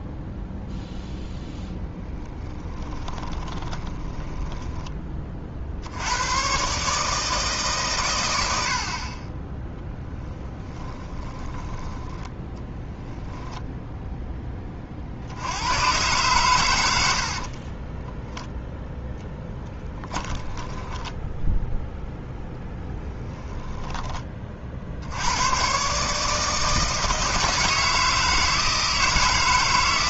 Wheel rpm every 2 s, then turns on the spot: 0, 20, 20, 130, 80, 30, 10, 30, 110, 10, 20, 10, 50, 160, 160.
2-6 10-14 20-22